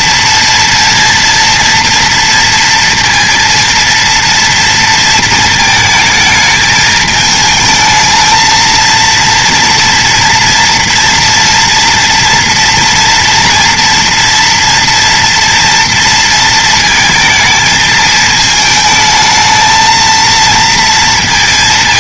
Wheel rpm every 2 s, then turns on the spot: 230, 230, 230, 220, 230, 230, 240, 230, 230, 220, 230.
none